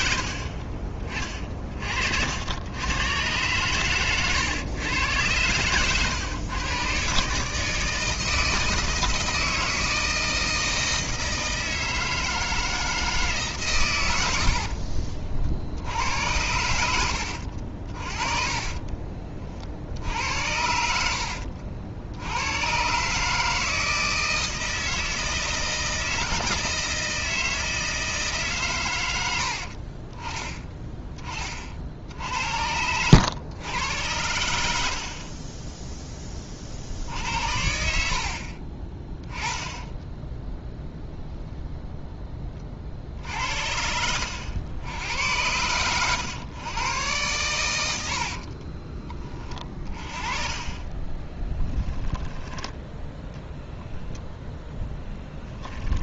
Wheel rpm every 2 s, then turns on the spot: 40, 100, 110, 120, 160, 160, 160, 60, 80, 30, 70, 120, 160, 160, 130, 10, 80, 110, 50, 40, 0, 30, 90, 120, 30, 30, 10, 10.
14-16 18-20 48-50